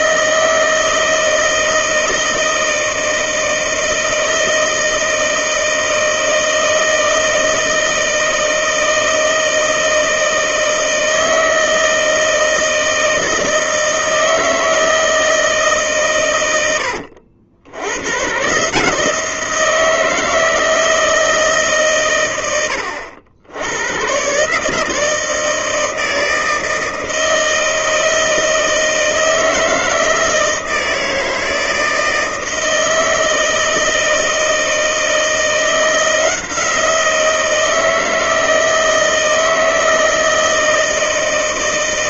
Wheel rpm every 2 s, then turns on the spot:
160, 160, 160, 160, 160, 160, 160, 160, 100, 140, 160, 100, 140, 160, 160, 160, 160, 160, 170, 160, 160.
none